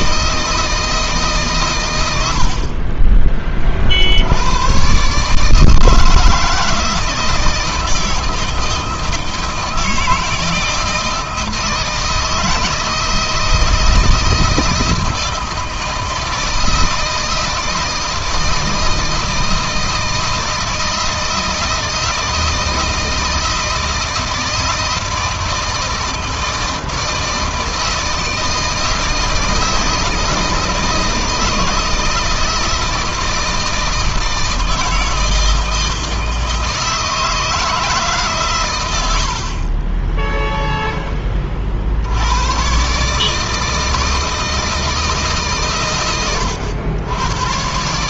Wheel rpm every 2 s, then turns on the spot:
160, 40, 130, 160, 160, 160, 160, 160, 160, 160, 160, 160, 160, 160, 160, 160, 160, 160, 160, 100, 10, 140, 160, 110.
none